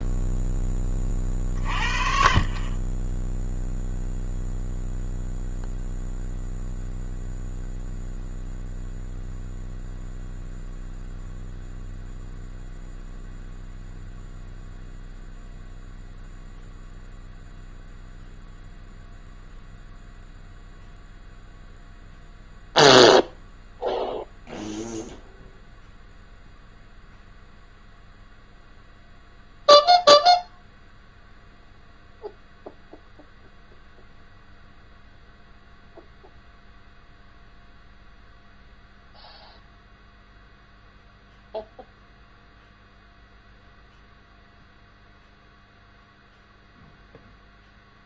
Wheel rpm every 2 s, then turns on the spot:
10, 30, 0, 0, 0, 0, 0, 0, 0, 0, 0, 0, 0, 0, 0, 0, 0, 0, 0, 0, 0, 0, 0, 0.
none